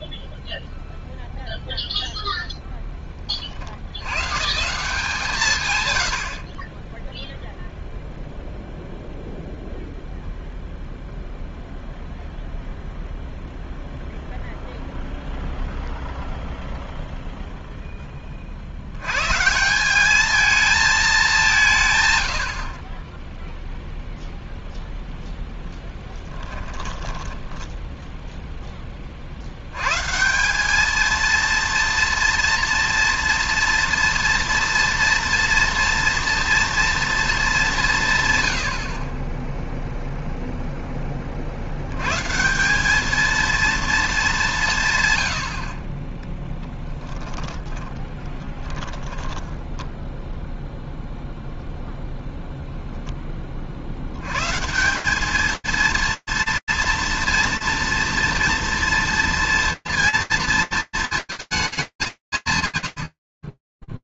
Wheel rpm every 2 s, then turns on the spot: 0, 50, 150, 0, 0, 0, 0, 0, 0, 140, 200, 10, 0, 10, 30, 220, 230, 230, 230, 50, 10, 200, 120, 10, 10, 0, 0, 160, 230, 230, 230, 150.
26-28 46-50